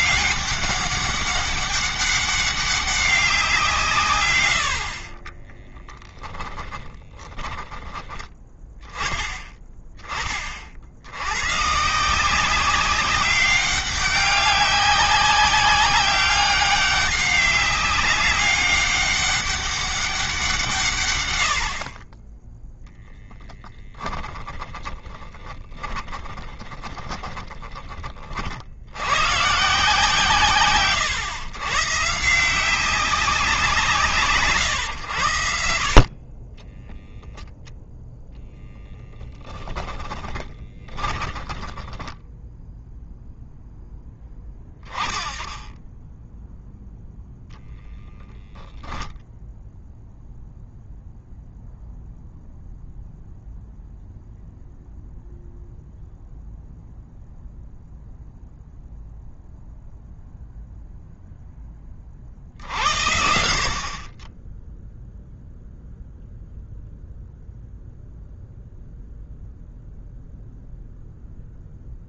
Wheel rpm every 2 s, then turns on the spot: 200, 190, 40, 20, 10, 50, 190, 200, 200, 200, 150, 0, 10, 20, 100, 140, 190, 110, 10, 10, 20, 0, 10, 0, 10, 0, 0, 0, 0, 0, 0, 60, 0, 0, 0, 0.
4-8 24-28 40-42